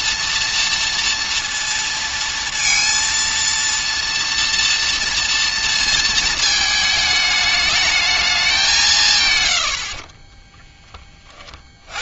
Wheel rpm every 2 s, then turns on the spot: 230, 230, 230, 220, 200, 30.
10-12